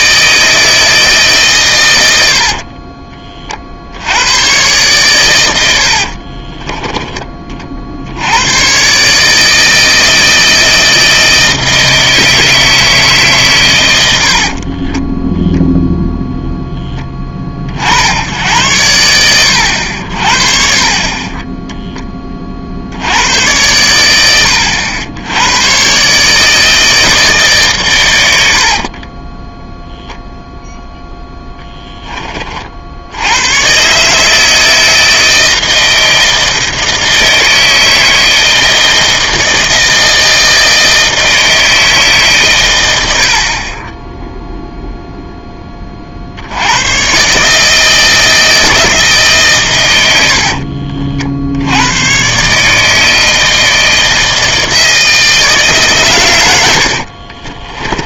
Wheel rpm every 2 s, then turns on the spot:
160, 40, 110, 20, 110, 160, 160, 50, 0, 90, 40, 40, 90, 150, 60, 0, 40, 160, 160, 160, 160, 120, 0, 90, 160, 50, 140, 160, 100.
2-4 6-8 14-16 28-30 50-52